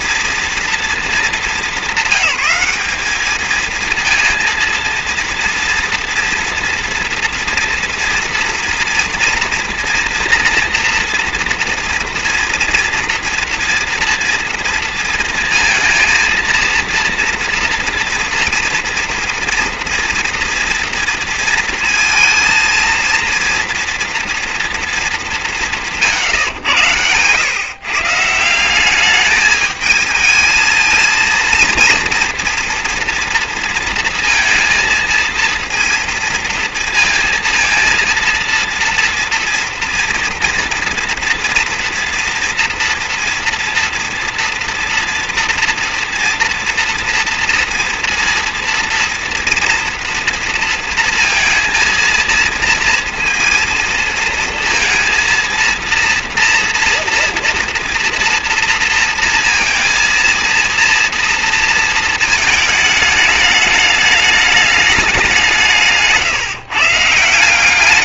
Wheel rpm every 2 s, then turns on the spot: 230, 210, 230, 240, 240, 240, 230, 230, 220, 230, 230, 230, 230, 140, 150, 220, 230, 230, 230, 230, 230, 230, 240, 230, 230, 230, 230, 230, 230, 230, 230, 220, 210, 150.
none